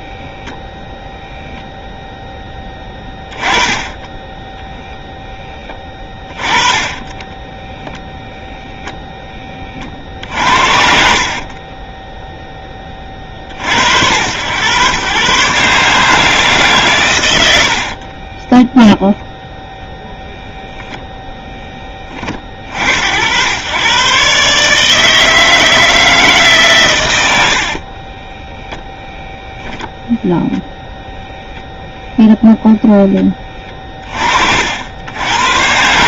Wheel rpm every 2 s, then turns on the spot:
0, 10, 0, 20, 10, 50, 30, 110, 120, 0, 0, 50, 150, 130, 0, 0, 10, 70.
none